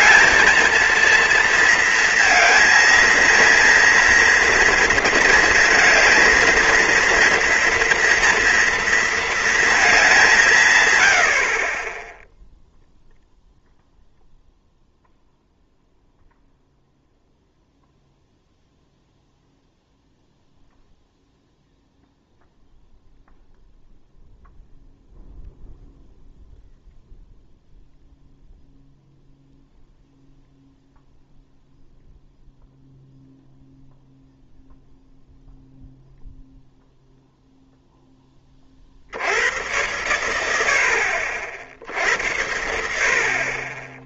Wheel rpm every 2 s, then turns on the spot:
230, 230, 230, 230, 230, 170, 0, 0, 0, 0, 0, 0, 0, 0, 0, 0, 0, 0, 0, 40, 80, 70.
none